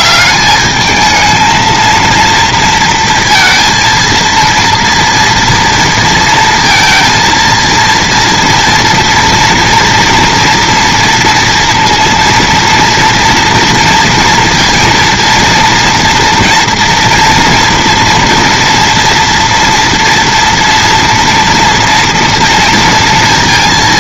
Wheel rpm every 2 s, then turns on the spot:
200, 230, 230, 230, 230, 240, 230, 230, 230, 230, 230, 230.
none